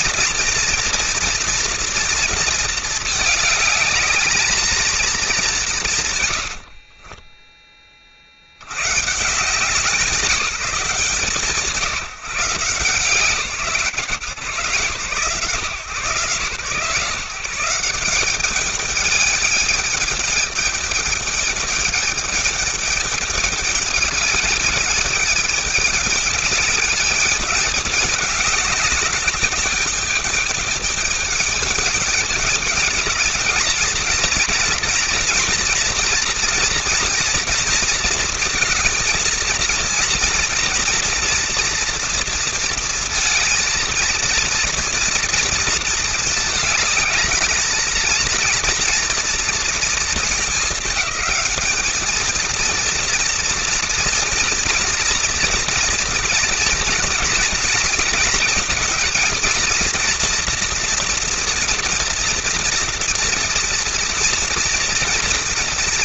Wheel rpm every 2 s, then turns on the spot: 240, 230, 220, 90, 80, 170, 160, 140, 130, 210, 210, 210, 220, 210, 200, 210, 200, 240, 230, 220, 240, 230, 230, 220, 230, 220, 230, 240, 230, 220, 230, 240, 230.
6-8